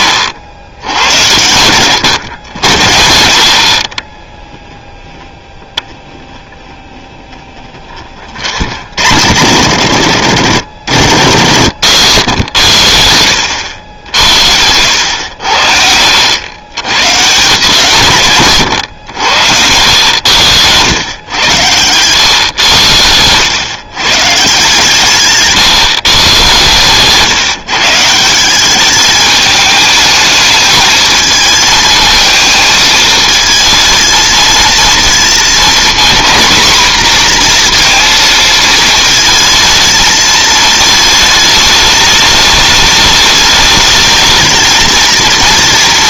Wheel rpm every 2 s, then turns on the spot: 80, 80, 0, 10, 50, 70, 100, 80, 100, 120, 110, 100, 160, 130, 190, 220, 220, 230, 240, 220, 220, 210, 220.
10-12